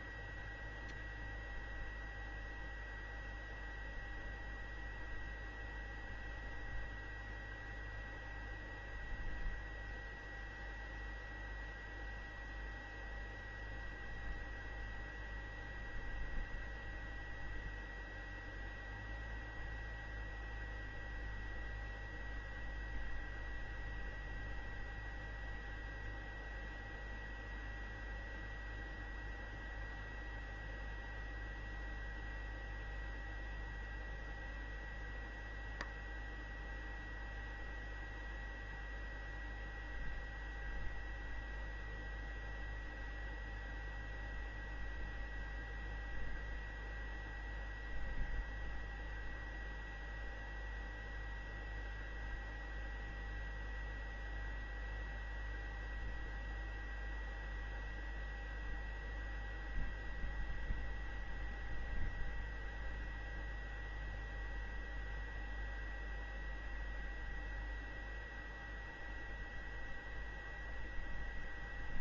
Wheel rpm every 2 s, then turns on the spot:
0, 0, 0, 0, 0, 0, 0, 0, 0, 0, 0, 0, 0, 0, 0, 0, 0, 0, 0, 0, 0, 0, 0, 0, 0, 0, 0, 0, 0, 0, 0, 0, 0, 0, 0, 0.
none